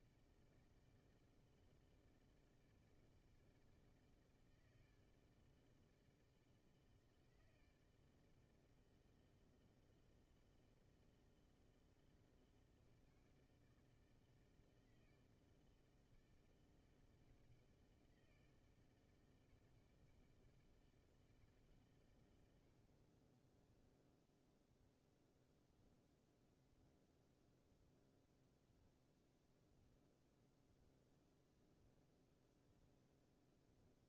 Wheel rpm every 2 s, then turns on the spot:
160, 160, 160, 160, 160, 160, 160, 160, 160, 160, 160, 90, 0, 0, 0, 0, 0.
none